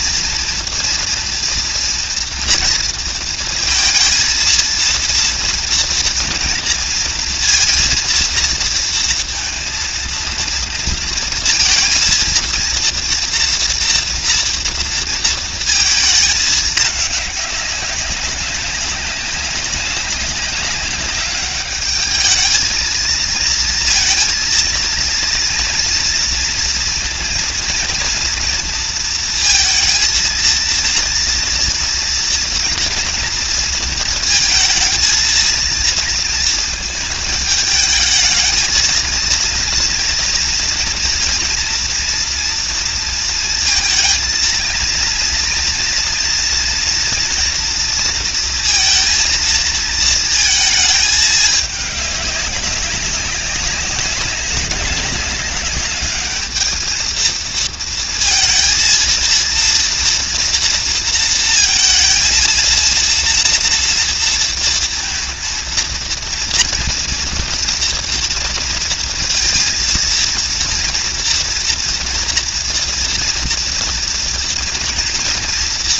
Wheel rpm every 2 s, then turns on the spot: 230, 230, 230, 230, 230, 230, 230, 230, 210, 200, 200, 220, 230, 230, 230, 230, 230, 230, 230, 220, 240, 230, 230, 230, 230, 220, 200, 200, 220, 230, 230, 230, 230, 230, 230, 230, 230, 230.
none